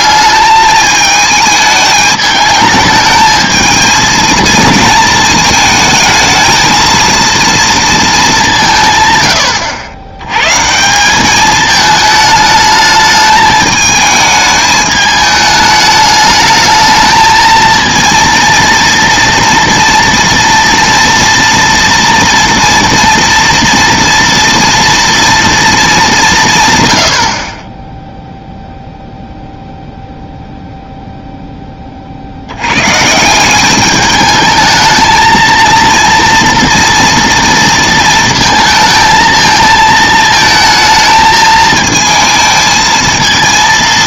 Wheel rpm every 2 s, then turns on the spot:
210, 210, 230, 220, 180, 140, 220, 210, 220, 230, 230, 230, 230, 140, 0, 0, 100, 220, 230, 220, 220, 220.
none